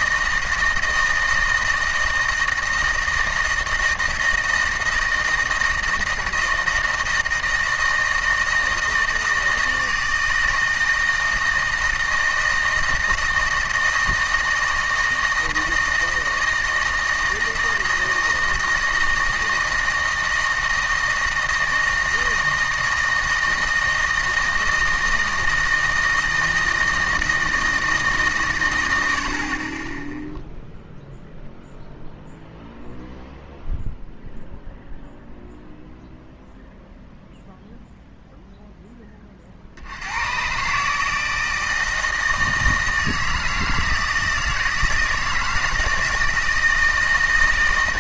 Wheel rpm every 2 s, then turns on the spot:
160, 160, 160, 160, 160, 160, 160, 160, 160, 160, 160, 160, 160, 160, 120, 0, 0, 0, 0, 0, 130, 160, 160, 160.
none